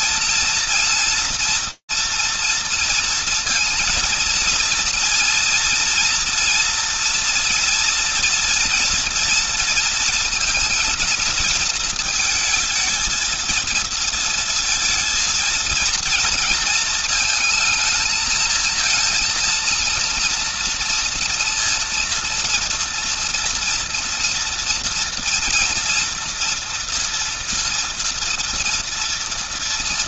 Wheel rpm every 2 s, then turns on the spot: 230, 230, 230, 230, 230, 230, 220, 230, 230, 230, 230, 240, 230, 230, 230.
none